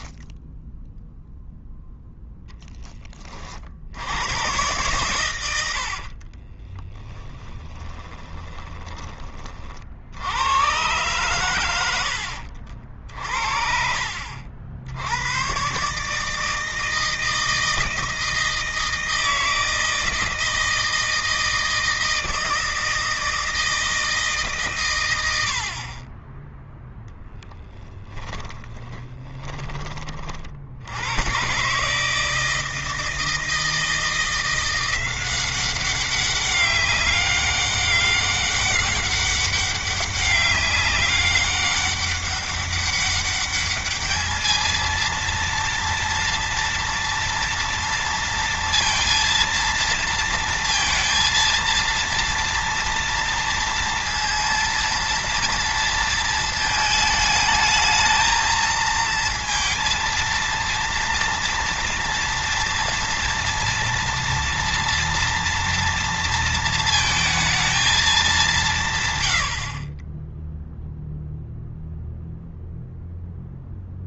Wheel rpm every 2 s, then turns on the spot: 0, 10, 120, 30, 20, 110, 60, 70, 160, 160, 160, 160, 130, 10, 20, 70, 160, 180, 200, 200, 200, 200, 220, 230, 230, 230, 230, 230, 220, 230, 230, 230, 230, 230, 150, 0, 0.
6-8 12-14 28-30